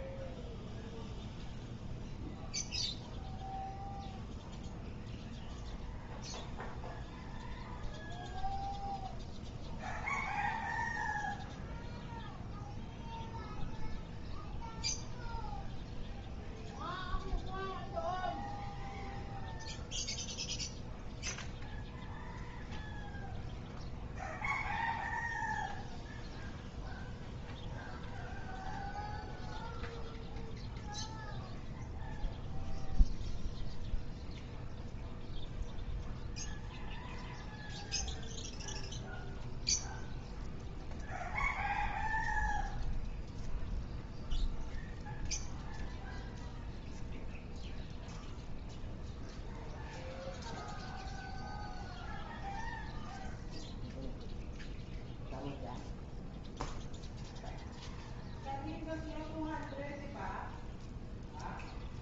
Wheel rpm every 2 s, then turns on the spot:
0, 0, 0, 0, 0, 0, 0, 0, 0, 0, 0, 0, 0, 0, 0, 0, 0, 0, 0, 0, 0, 0, 0, 0, 0, 0, 0, 0, 0, 0, 0.
none